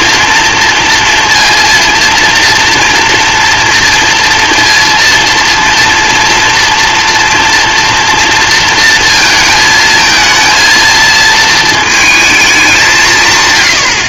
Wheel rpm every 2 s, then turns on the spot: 230, 230, 230, 240, 230, 230, 200.
none